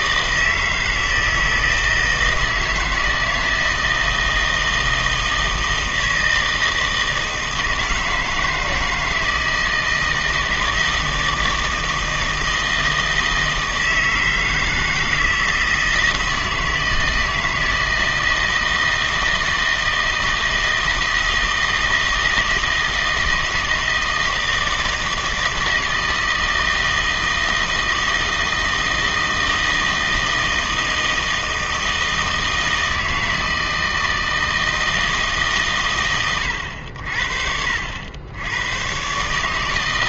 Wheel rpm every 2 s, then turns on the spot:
160, 160, 160, 160, 160, 160, 160, 160, 160, 160, 160, 160, 160, 160, 160, 160, 160, 160, 100, 110.
none